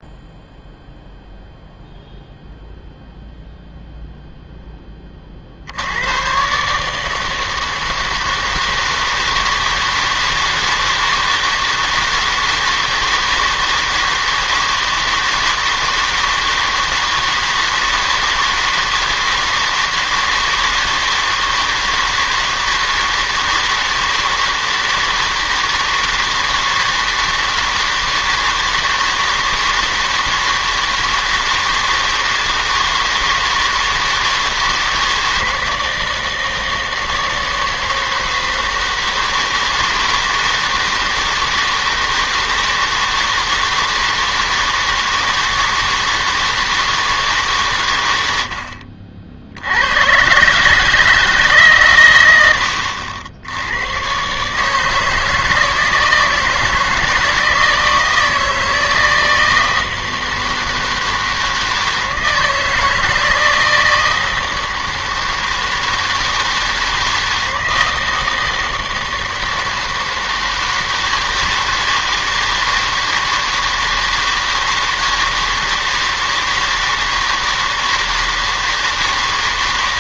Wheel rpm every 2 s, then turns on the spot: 0, 0, 0, 130, 160, 160, 160, 160, 160, 160, 160, 160, 160, 160, 160, 160, 160, 160, 160, 160, 160, 160, 160, 160, 80, 140, 90, 150, 160, 160, 160, 160, 160, 160, 160, 160, 160, 160, 160, 160.
none